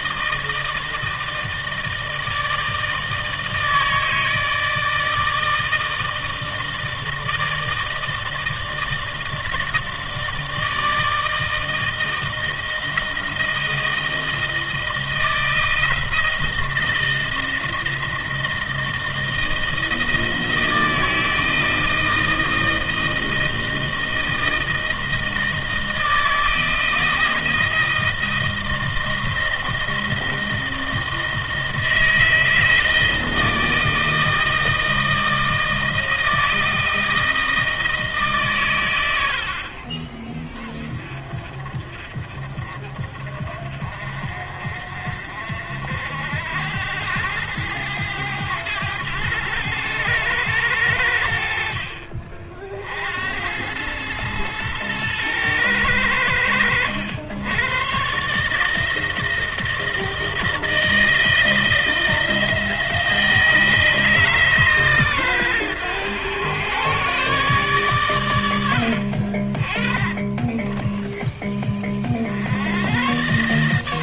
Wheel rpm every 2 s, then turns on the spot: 160, 160, 160, 160, 160, 160, 160, 160, 160, 160, 160, 160, 160, 160, 160, 160, 160, 160, 160, 120, 30, 50, 50, 90, 100, 100, 60, 110, 90, 150, 160, 160, 140, 120, 90, 20, 80.
68-72